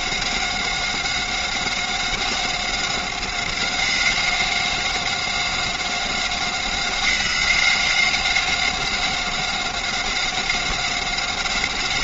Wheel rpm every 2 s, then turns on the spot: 190, 190, 190, 180, 190, 190.
none